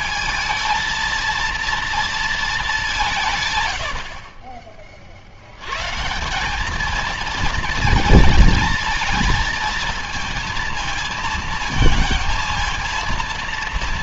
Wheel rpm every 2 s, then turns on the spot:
230, 180, 60, 220, 220, 230, 230.
none